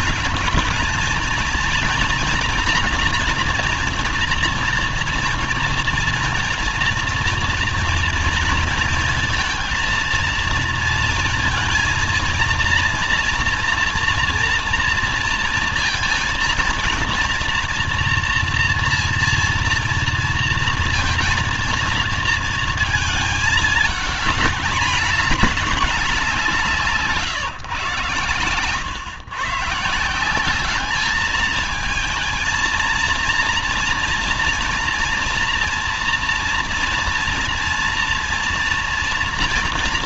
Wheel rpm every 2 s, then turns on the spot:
230, 240, 240, 230, 230, 230, 230, 230, 230, 240, 230, 220, 210, 150, 120, 210, 230, 230, 230, 230.
none